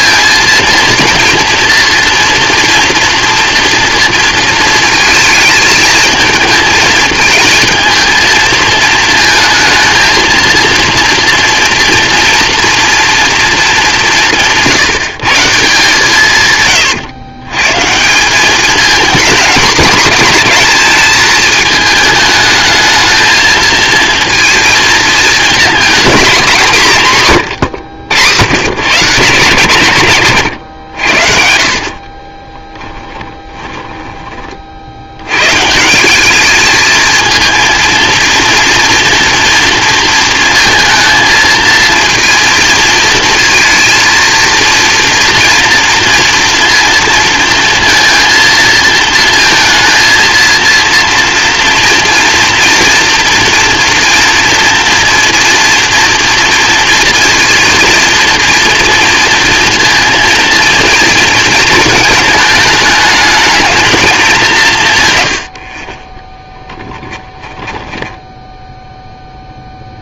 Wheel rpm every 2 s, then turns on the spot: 230, 230, 230, 220, 220, 230, 230, 160, 120, 210, 210, 220, 230, 200, 130, 80, 10, 50, 220, 230, 230, 230, 230, 230, 230, 230, 230, 230, 230, 240, 230, 210, 160, 10, 0.
32-34 66-68